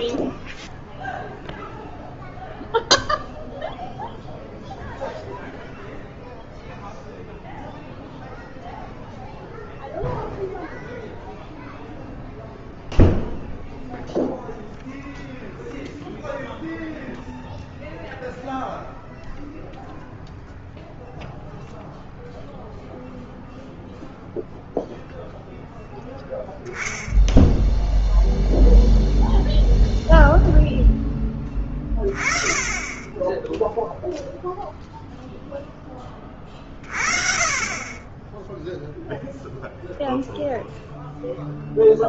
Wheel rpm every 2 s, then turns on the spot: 0, 0, 0, 0, 0, 0, 0, 0, 0, 0, 0, 0, 0, 10, 0, 0, 20, 0, 40, 10, 0.
none